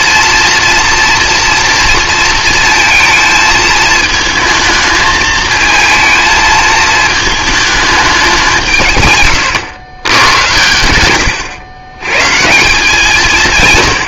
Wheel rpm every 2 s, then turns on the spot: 230, 230, 220, 220, 170, 100, 170.
none